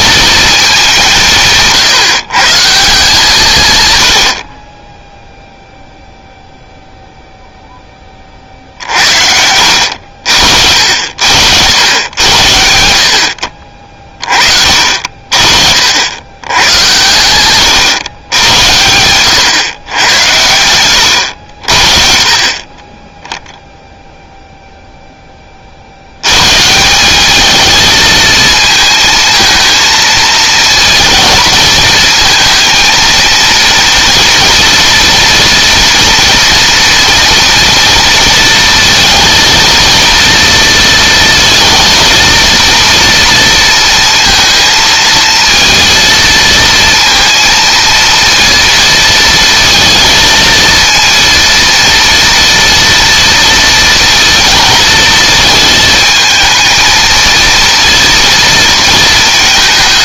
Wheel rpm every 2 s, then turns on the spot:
210, 150, 20, 0, 60, 70, 80, 50, 110, 90, 100, 20, 0, 160, 220, 230, 230, 230, 230, 230, 230, 230, 230, 230, 230, 230, 230, 230, 220, 230.
none